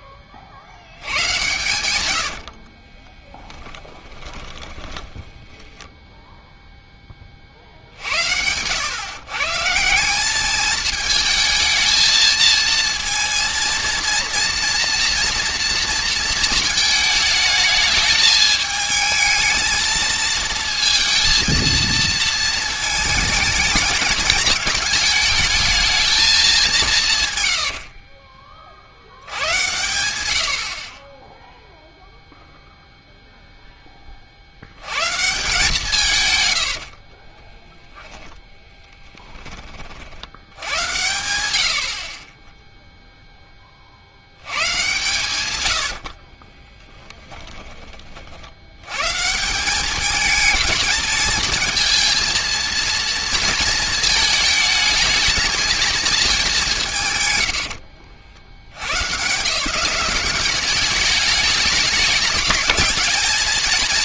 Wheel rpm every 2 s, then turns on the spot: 70, 50, 20, 0, 100, 210, 220, 230, 220, 210, 230, 220, 220, 200, 50, 60, 0, 70, 90, 10, 80, 10, 110, 20, 80, 220, 230, 220, 220, 100, 200, 220.
2-6 36-40 46-48